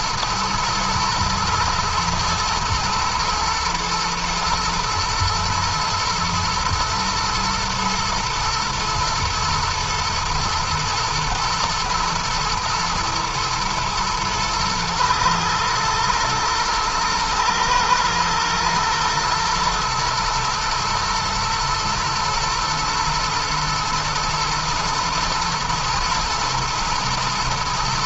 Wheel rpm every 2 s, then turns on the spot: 110, 120, 110, 110, 120, 120, 110, 110, 110, 110, 120, 110, 120, 110.
none